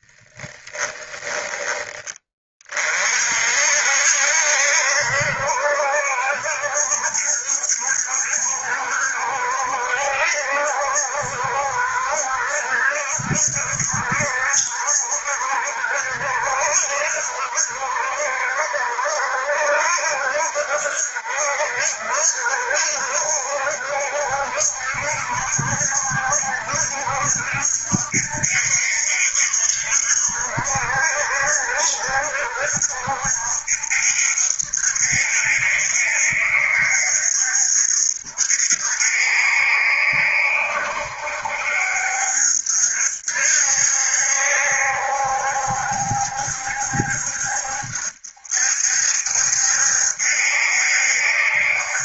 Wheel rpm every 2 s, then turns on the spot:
10, 40, 70, 70, 70, 70, 70, 70, 70, 70, 70, 70, 70, 70, 70, 70, 70, 70, 70, 60, 70, 70, 70, 70, 70, 70.
0-2